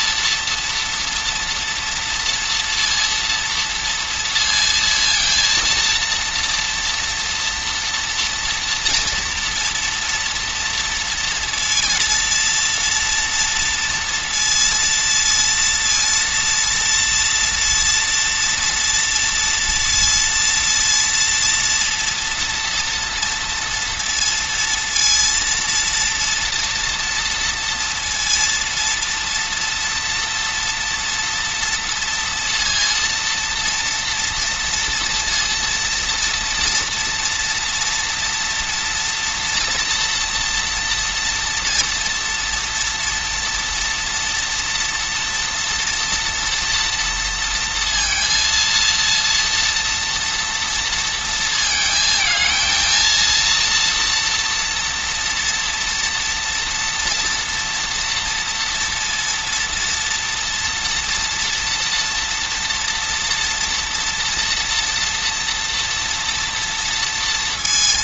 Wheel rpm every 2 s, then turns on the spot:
230, 230, 230, 230, 230, 230, 230, 230, 230, 230, 230, 240, 230, 240, 230, 230, 230, 230, 230, 230, 230, 230, 230, 230, 230, 230, 230, 240, 240, 230, 230, 240, 230, 230.
none